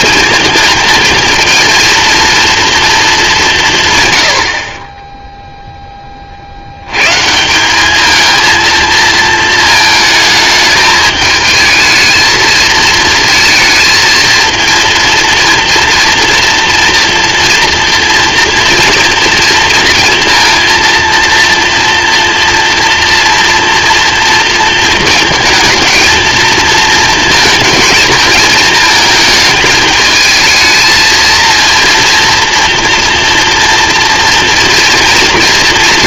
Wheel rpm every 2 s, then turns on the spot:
220, 230, 20, 90, 230, 210, 220, 230, 230, 230, 230, 240, 230, 230, 220, 220, 230, 230.
none